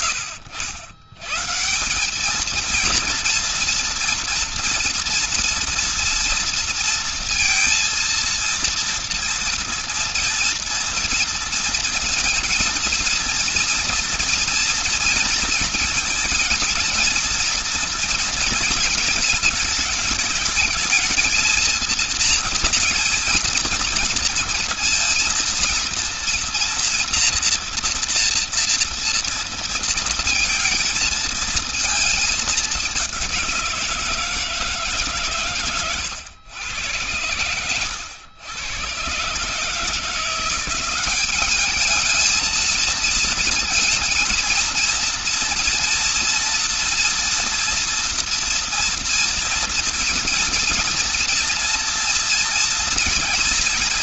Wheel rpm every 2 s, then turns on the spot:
120, 210, 230, 230, 230, 230, 230, 230, 230, 230, 220, 230, 230, 230, 230, 230, 220, 160, 120, 100, 170, 220, 230, 230, 240, 230, 230.
none